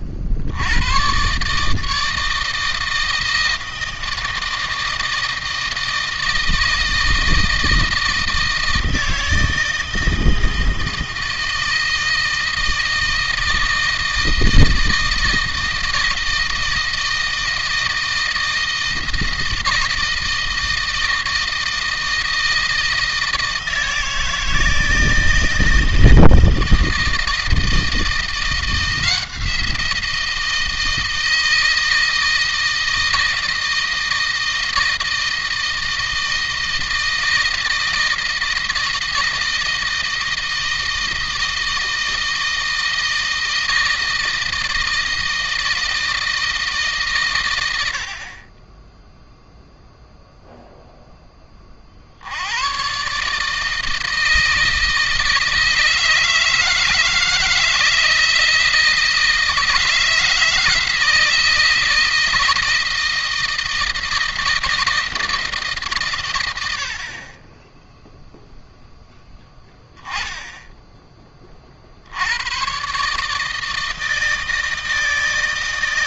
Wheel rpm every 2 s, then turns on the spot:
50, 160, 160, 160, 160, 160, 160, 160, 160, 160, 160, 160, 160, 160, 170, 160, 160, 160, 160, 160, 160, 160, 160, 150, 20, 0, 100, 160, 160, 160, 170, 160, 160, 70, 0, 10, 130, 160.
none